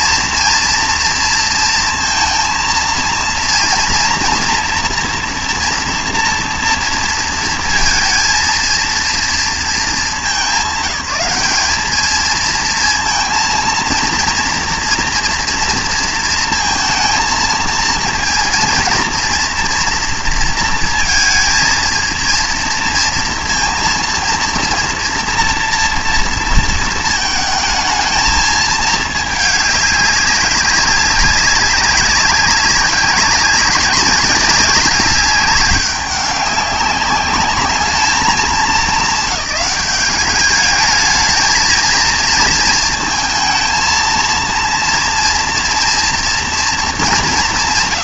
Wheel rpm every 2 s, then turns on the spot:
230, 230, 230, 230, 230, 190, 230, 230, 220, 230, 230, 230, 240, 230, 220, 200, 200, 200, 200, 210, 220, 220, 230, 230.
none